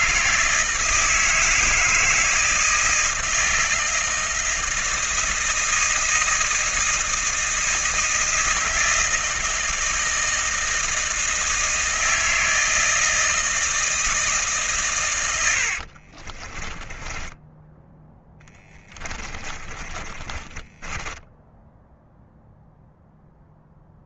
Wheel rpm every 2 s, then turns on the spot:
160, 160, 160, 160, 160, 160, 160, 110, 10, 20, 20, 0.
16-22